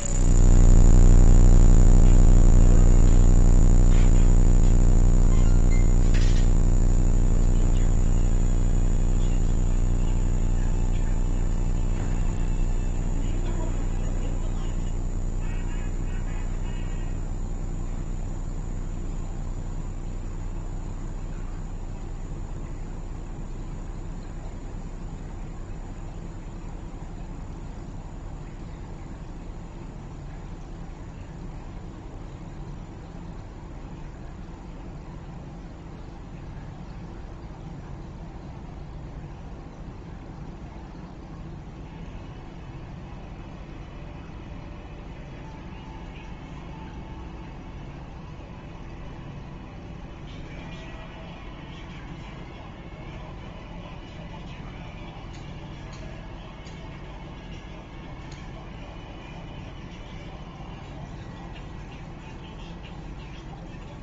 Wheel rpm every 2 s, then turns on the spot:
0, 0, 0, 0, 0, 0, 0, 0, 0, 0, 0, 0, 0, 0, 0, 0, 0, 0, 0, 0, 0, 0, 0, 0, 0, 0, 0, 0, 0, 0, 0, 0.
none